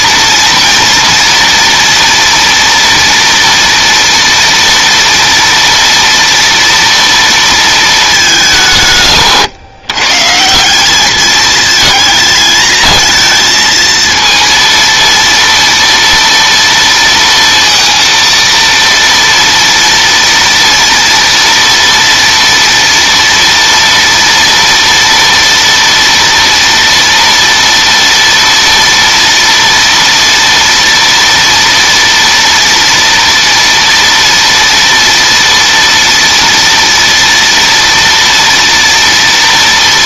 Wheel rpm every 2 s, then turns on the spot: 230, 240, 230, 230, 210, 130, 220, 230, 230, 230, 230, 230, 230, 230, 230, 230, 240, 230, 230, 230.
none